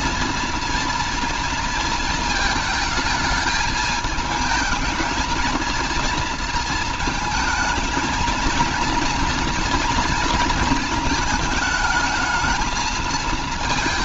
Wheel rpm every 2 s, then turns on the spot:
230, 220, 220, 230, 230, 230, 220.
none